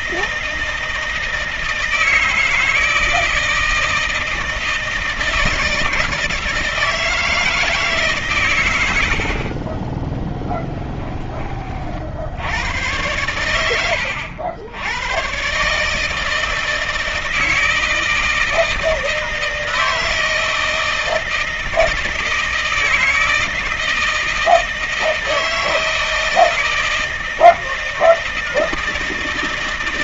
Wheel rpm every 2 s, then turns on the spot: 160, 160, 160, 160, 80, 20, 100, 100, 160, 160, 160, 160, 160, 160, 160.
10-12